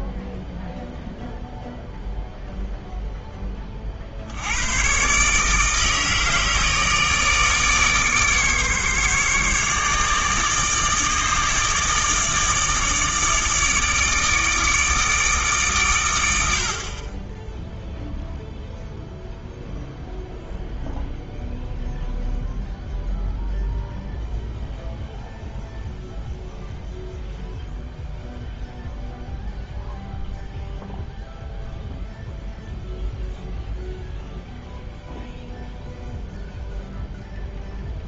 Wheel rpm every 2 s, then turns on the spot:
0, 0, 100, 150, 150, 150, 160, 160, 60, 0, 0, 0, 0, 0, 0, 0, 0, 0, 0.
none